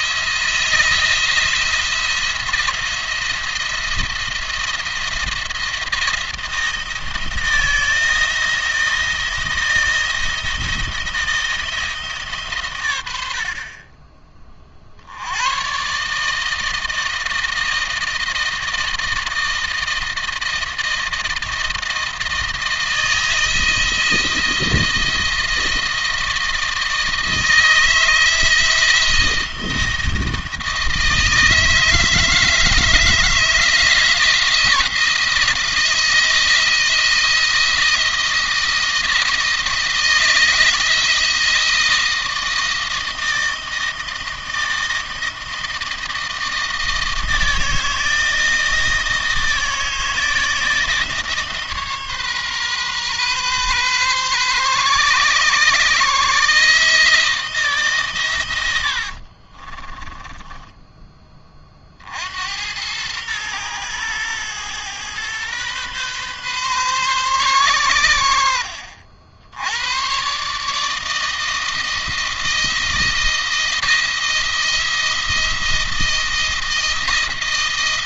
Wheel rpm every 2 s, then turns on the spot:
160, 170, 170, 160, 160, 160, 120, 40, 160, 160, 160, 160, 170, 160, 160, 160, 160, 160, 160, 170, 160, 160, 160, 160, 160, 160, 130, 130, 150, 90, 10, 90, 120, 130, 70, 140, 160, 170, 170.
58-62